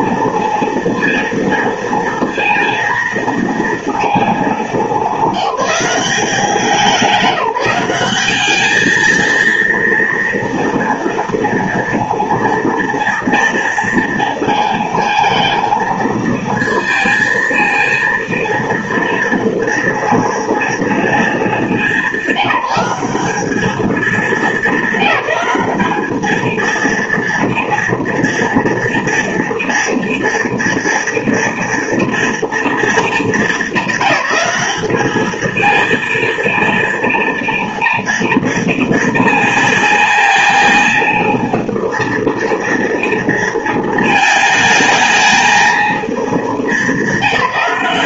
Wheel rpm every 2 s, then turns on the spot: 230, 230, 210, 190, 210, 230, 230, 230, 220, 230, 230, 190, 220, 220, 230, 230, 230, 210, 230, 230, 230, 230, 220, 210.
none